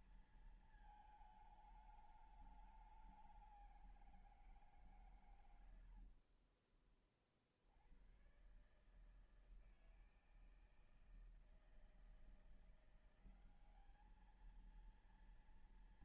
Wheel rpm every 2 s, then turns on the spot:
220, 210, 170, 50, 120, 160, 170, 220.
6-8